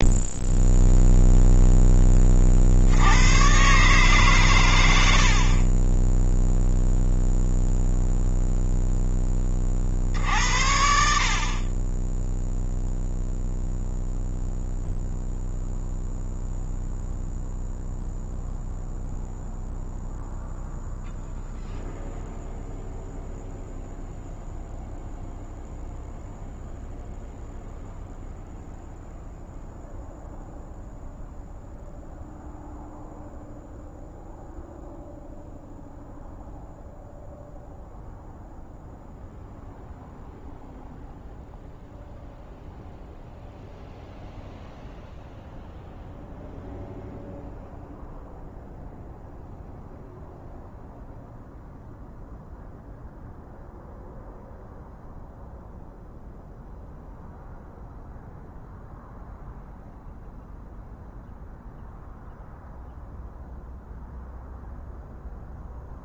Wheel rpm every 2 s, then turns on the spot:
0, 70, 100, 0, 0, 60, 0, 0, 0, 0, 0, 0, 0, 0, 0, 0, 0, 0, 0, 0, 0, 0, 0, 0, 0, 0, 0, 0, 0, 0, 0, 0, 0.
none